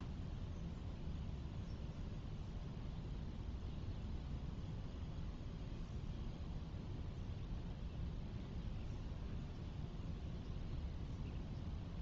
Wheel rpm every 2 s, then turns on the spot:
0, 0, 0, 0, 0, 0.
none